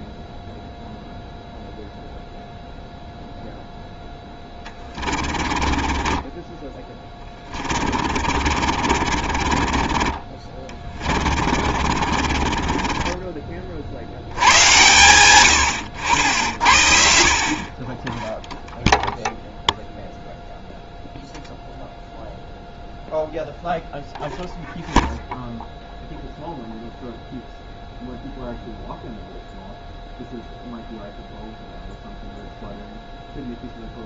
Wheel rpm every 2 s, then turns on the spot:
0, 0, 20, 20, 40, 20, 30, 110, 70, 0, 0, 0, 0, 0, 0, 0, 0.
4-14